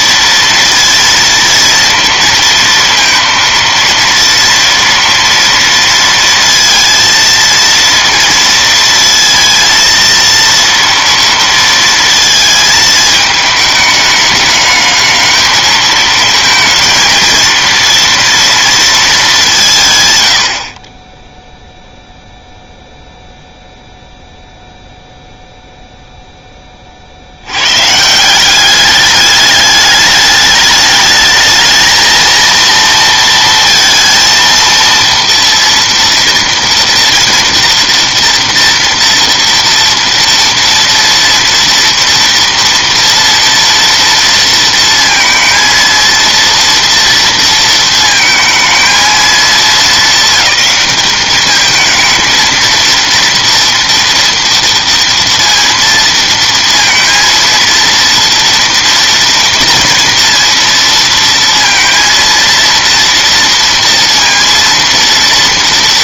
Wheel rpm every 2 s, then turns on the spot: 230, 230, 230, 230, 230, 230, 220, 210, 230, 210, 10, 0, 0, 50, 200, 210, 230, 230, 230, 230, 230, 230, 230, 230, 220, 200, 230, 230, 230, 230, 230, 230, 230.
none